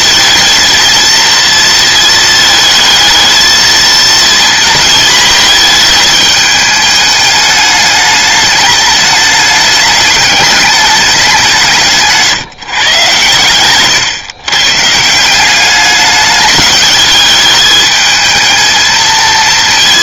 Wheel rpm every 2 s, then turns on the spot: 230, 220, 230, 210, 210, 210, 140, 140, 210, 220.
none